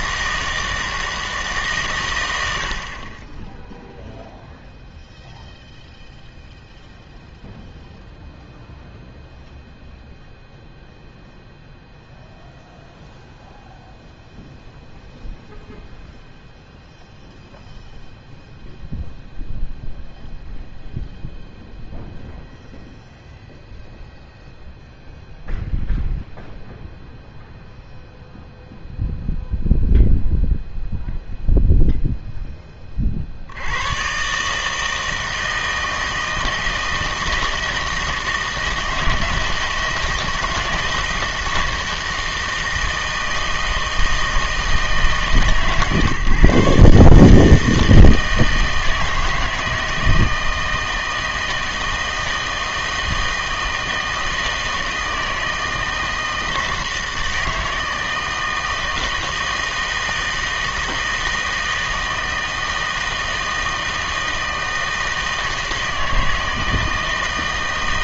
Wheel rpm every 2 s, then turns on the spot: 160, 70, 0, 0, 0, 0, 0, 0, 0, 0, 0, 0, 0, 0, 0, 0, 20, 150, 170, 160, 160, 160, 160, 140, 160, 160, 160, 160, 160, 160, 160, 160, 160, 160.
none